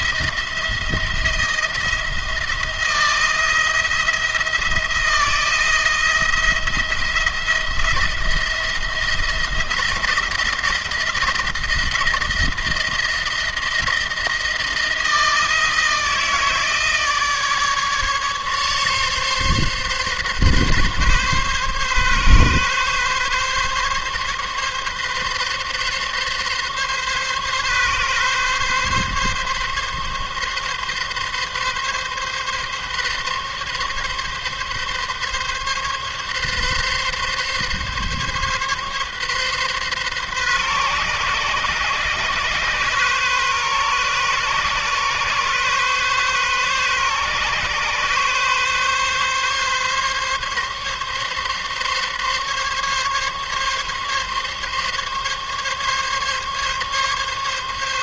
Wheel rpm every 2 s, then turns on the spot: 170, 160, 170, 170, 170, 170, 170, 160, 160, 140, 140, 140, 140, 140, 140, 140, 140, 140, 140, 140, 130, 140, 140, 140, 140, 140, 140, 140, 140.
none